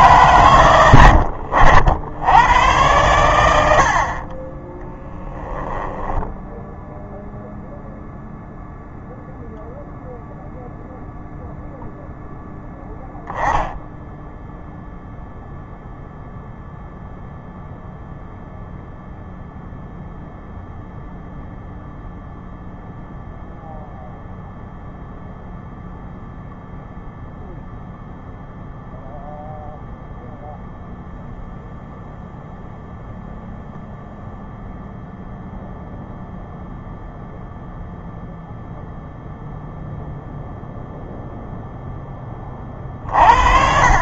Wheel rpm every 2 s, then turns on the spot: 80, 100, 10, 0, 0, 0, 10, 0, 0, 0, 0, 0, 0, 0, 0, 0, 0, 0, 0, 0, 0, 40.
4-6